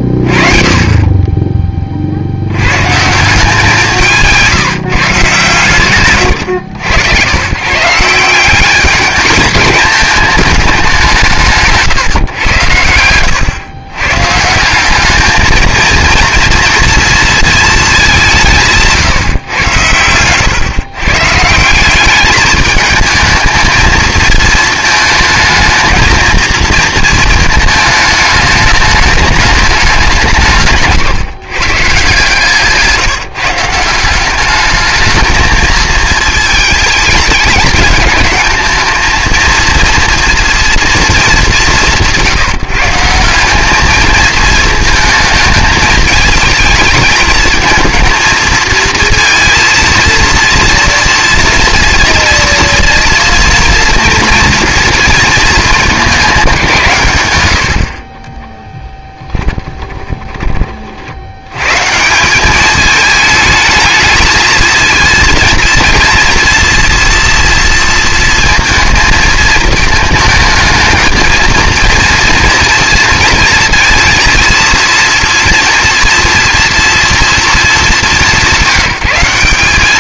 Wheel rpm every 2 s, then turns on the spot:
20, 100, 170, 120, 190, 210, 110, 170, 240, 160, 130, 210, 220, 230, 210, 160, 150, 210, 210, 220, 230, 170, 220, 220, 230, 230, 230, 240, 180, 20, 30, 210, 220, 230, 220, 230, 230, 230, 230, 150.
58-60